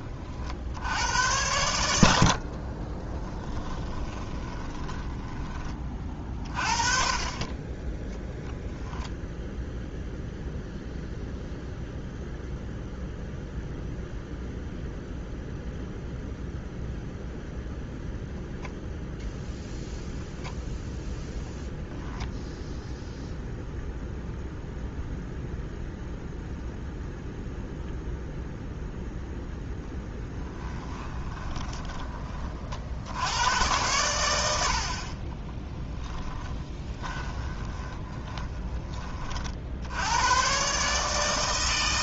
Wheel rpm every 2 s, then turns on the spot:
70, 30, 20, 30, 0, 0, 0, 0, 0, 0, 0, 0, 0, 0, 0, 20, 50, 60, 20, 20, 140.
2-6 30-32 36-38